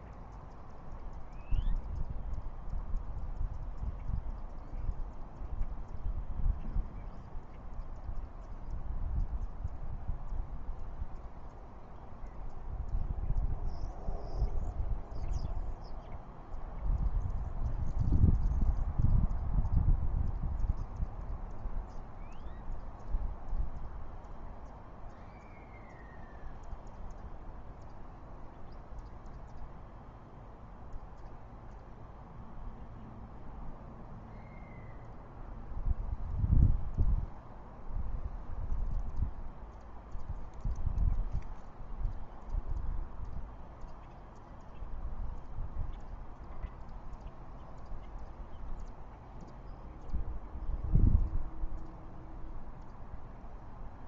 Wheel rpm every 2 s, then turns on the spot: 0, 0, 0, 0, 0, 0, 0, 0, 0, 0, 0, 0, 0, 0, 0, 0, 0, 0, 0, 0, 0, 0, 0, 0, 0, 0, 0.
none